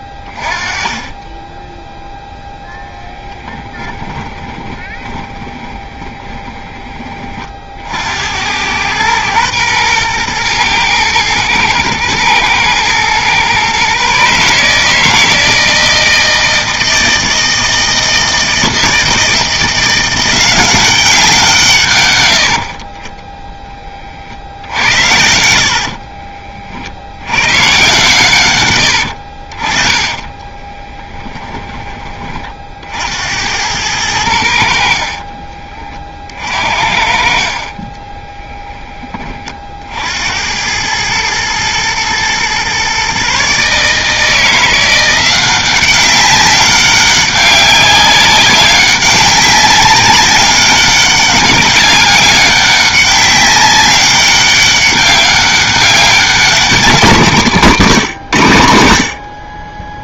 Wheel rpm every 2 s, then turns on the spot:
20, 10, 20, 30, 110, 110, 120, 150, 160, 160, 190, 40, 70, 50, 100, 20, 60, 60, 50, 20, 100, 130, 170, 190, 190, 200, 200, 200, 200, 90.
4-6 22-24 30-32 38-40